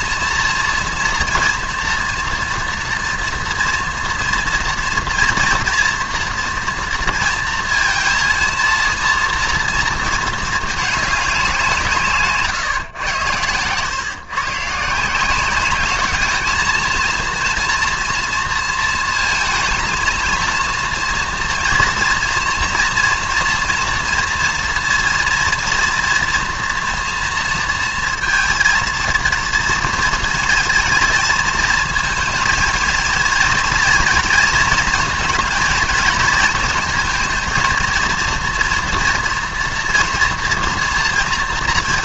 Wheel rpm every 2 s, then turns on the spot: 230, 230, 230, 230, 230, 220, 130, 140, 220, 230, 230, 230, 240, 240, 230, 230, 220, 230, 230, 230, 230.
none